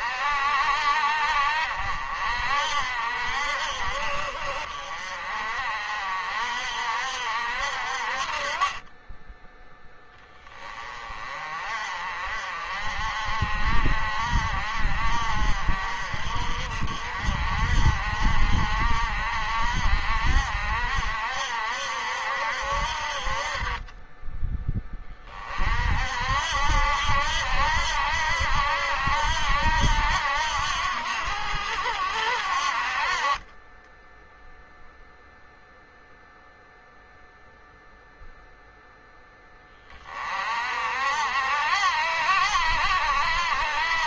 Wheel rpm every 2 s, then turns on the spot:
60, 60, 50, 60, 20, 30, 50, 50, 50, 60, 60, 50, 20, 70, 80, 80, 50, 0, 0, 0, 60, 70.
none